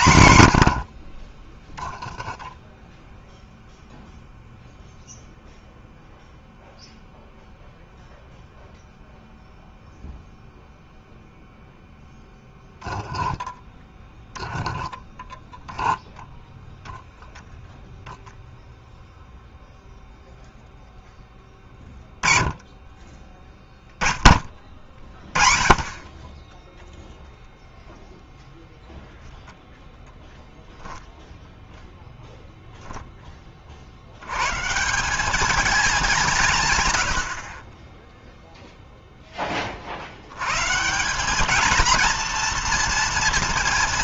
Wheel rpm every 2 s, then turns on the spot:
80, 0, 0, 0, 0, 0, 0, 0, 0, 0, 0, 20, 20, 0, 0, 10, 10, 130, 150, 0, 130, 230.
none